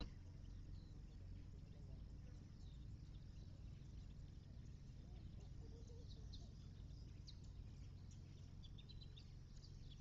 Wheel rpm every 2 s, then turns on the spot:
0, 0, 0, 0, 0.
none